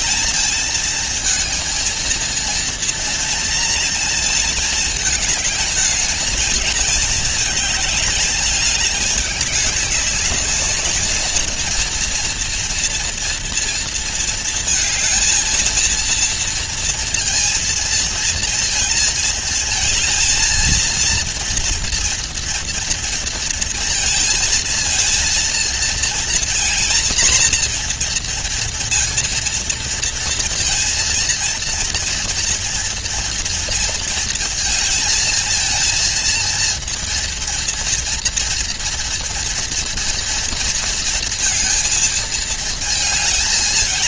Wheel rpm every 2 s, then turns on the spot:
220, 230, 220, 220, 210, 210, 230, 220, 230, 230, 230, 230, 230, 240, 230, 230, 230, 220, 230, 230, 230, 220.
none